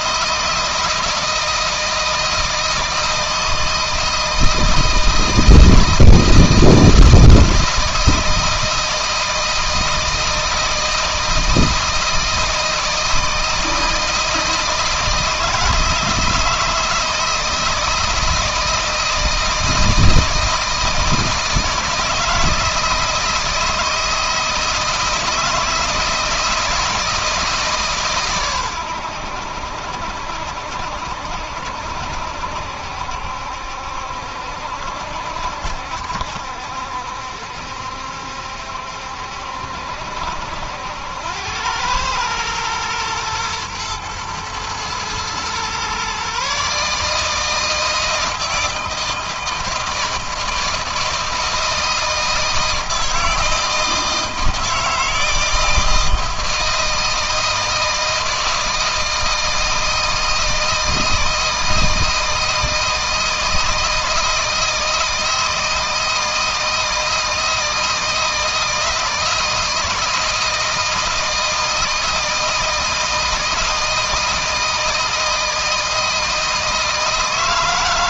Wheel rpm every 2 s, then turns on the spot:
160, 160, 160, 160, 160, 160, 160, 160, 160, 160, 160, 160, 160, 160, 100, 70, 70, 60, 70, 70, 80, 120, 120, 150, 160, 160, 160, 160, 160, 160, 160, 160, 160, 160, 160, 160, 160, 160, 160.
none